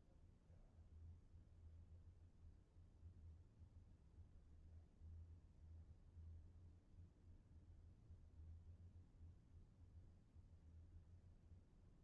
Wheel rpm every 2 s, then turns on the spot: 0, 0, 0, 0, 0, 0.
none